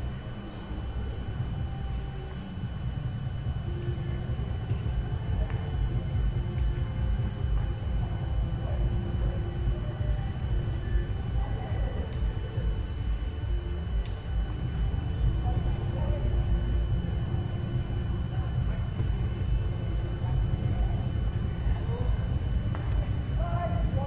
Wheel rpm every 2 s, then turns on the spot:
0, 0, 0, 0, 0, 0, 0, 0, 0, 0, 0, 0.
none